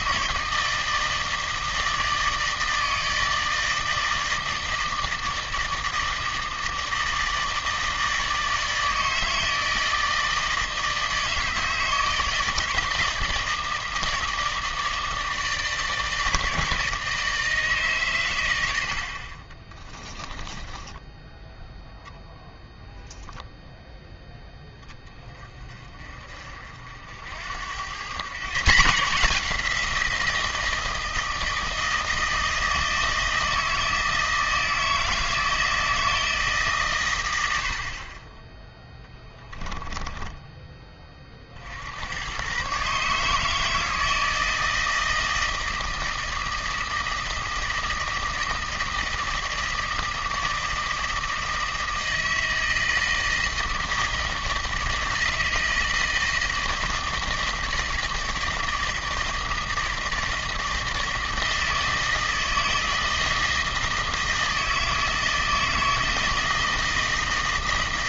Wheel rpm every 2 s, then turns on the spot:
160, 160, 160, 160, 160, 160, 160, 160, 160, 80, 10, 0, 10, 60, 160, 160, 160, 160, 130, 10, 20, 140, 160, 160, 160, 160, 160, 160, 160, 160, 160, 160, 160, 160.
20-22